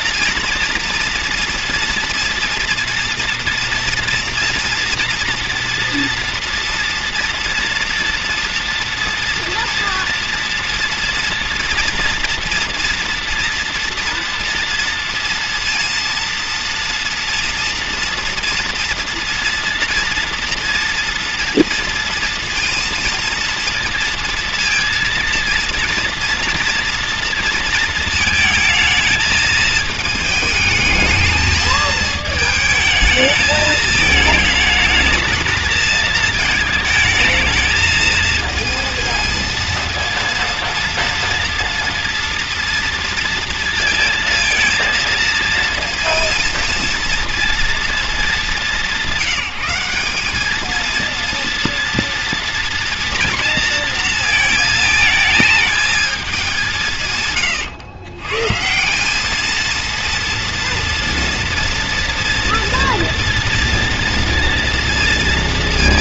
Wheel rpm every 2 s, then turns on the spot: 230, 230, 240, 230, 230, 230, 230, 230, 240, 230, 230, 230, 230, 230, 220, 220, 220, 220, 220, 230, 230, 230, 220, 230, 180, 220, 230, 220, 180, 180, 230, 230, 230.
none